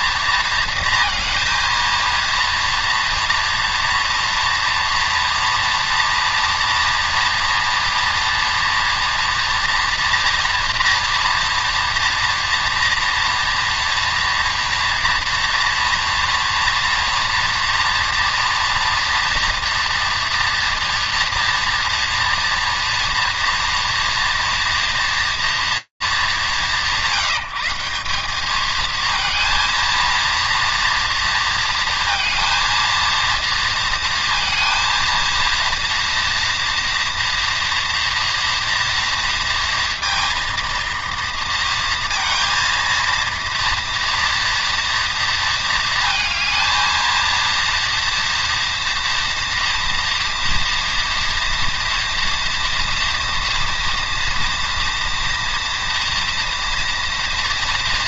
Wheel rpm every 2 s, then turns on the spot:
230, 230, 230, 230, 240, 230, 230, 240, 230, 240, 230, 230, 230, 180, 230, 230, 230, 230, 240, 230, 230, 230, 220, 230, 230, 230, 230, 230, 240.
none